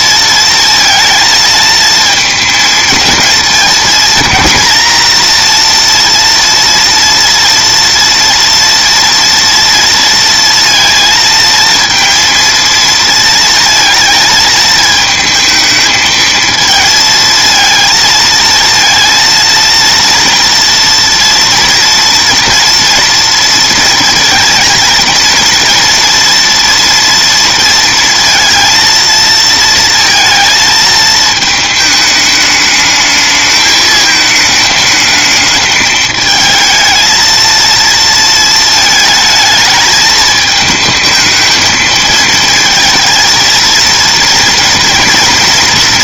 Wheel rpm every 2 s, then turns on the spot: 230, 230, 230, 230, 230, 230, 230, 220, 220, 230, 230, 230, 230, 230, 230, 220, 210, 220, 220, 220, 220, 230, 230.
none